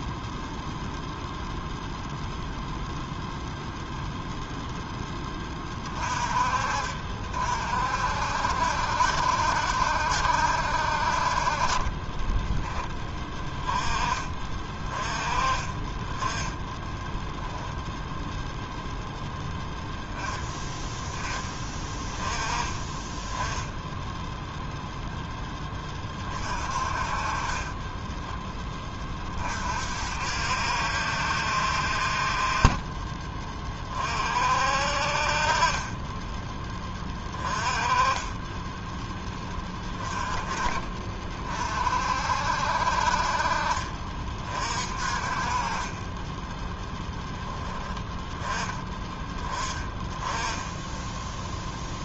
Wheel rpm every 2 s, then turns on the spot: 0, 0, 0, 50, 60, 60, 10, 30, 10, 0, 10, 20, 0, 40, 10, 70, 30, 50, 20, 10, 30, 60, 40, 10, 10, 10.
50-52